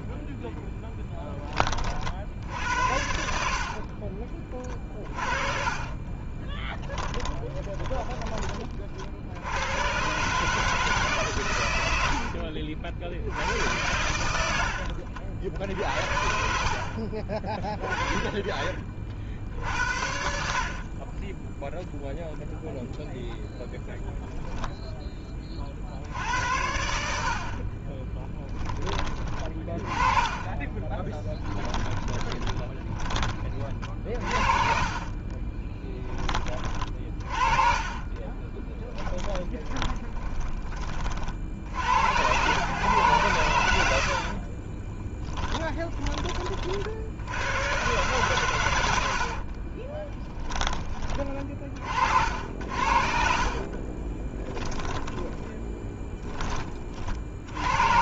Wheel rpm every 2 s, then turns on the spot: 10, 70, 30, 10, 50, 150, 50, 80, 60, 60, 30, 0, 0, 80, 20, 20, 10, 40, 30, 10, 20, 120, 30, 50, 90, 20, 60, 10, 30.
4-8 30-40 44-46 52-56